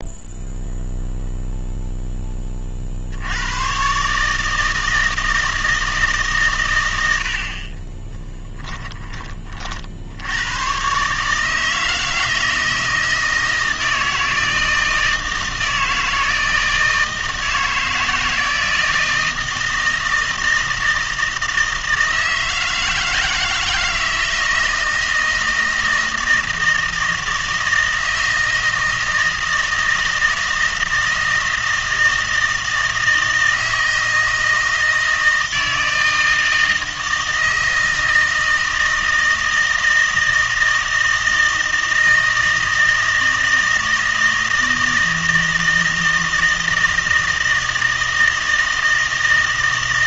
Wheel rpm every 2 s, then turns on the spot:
0, 40, 160, 120, 10, 110, 160, 160, 160, 160, 160, 160, 160, 160, 160, 160, 160, 160, 160, 160, 160, 160, 160, 160, 160.
none